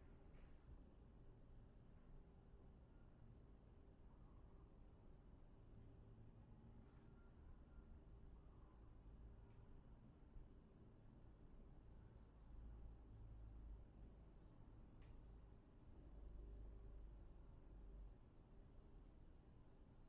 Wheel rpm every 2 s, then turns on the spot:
0, 0, 0, 0, 0, 0, 0, 0, 0, 0.
none